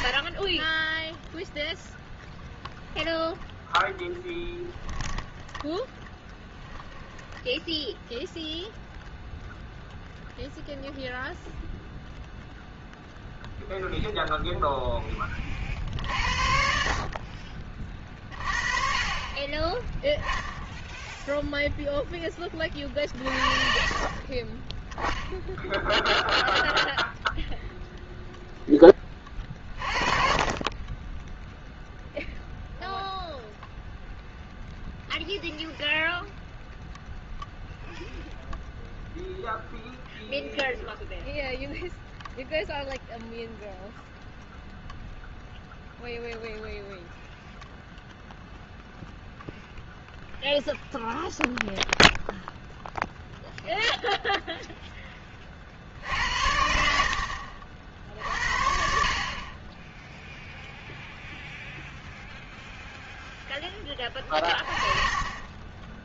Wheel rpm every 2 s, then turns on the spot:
10, 0, 10, 0, 0, 0, 0, 0, 60, 30, 0, 30, 20, 0, 10, 30, 0, 0, 0, 0, 0, 0, 0, 0, 0, 0, 0, 0, 70, 60, 0, 0, 30.
4-6